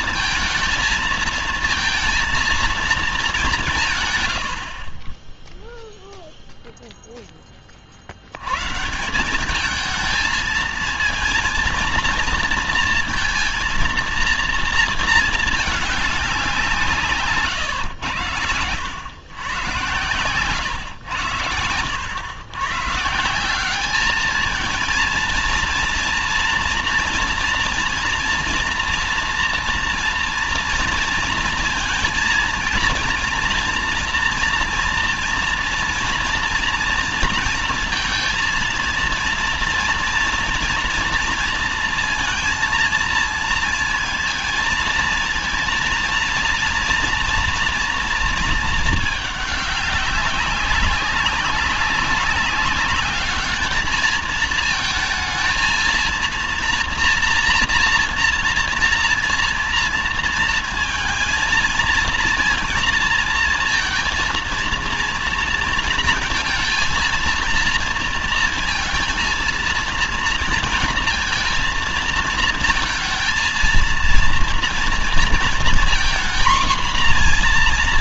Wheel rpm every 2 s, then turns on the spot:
230, 220, 40, 0, 150, 230, 230, 230, 170, 100, 100, 140, 220, 240, 230, 230, 230, 230, 230, 230, 230, 230, 230, 240, 220, 200, 200, 220, 230, 230, 230, 230, 230, 230, 230, 230, 230, 230, 240.
none